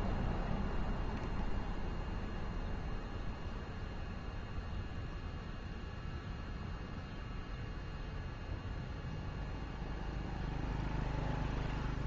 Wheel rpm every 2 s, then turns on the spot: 0, 0, 0, 0, 0, 0.
none